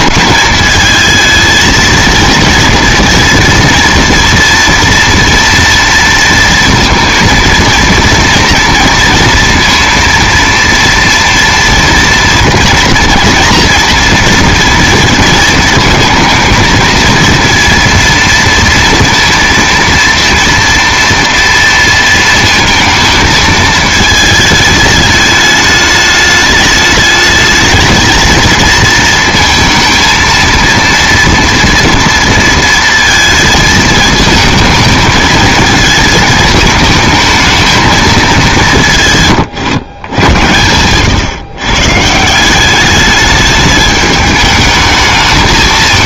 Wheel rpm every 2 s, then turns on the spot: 220, 230, 230, 230, 230, 230, 230, 230, 220, 230, 230, 230, 210, 210, 230, 230, 230, 220, 220, 160, 120, 200, 220.
none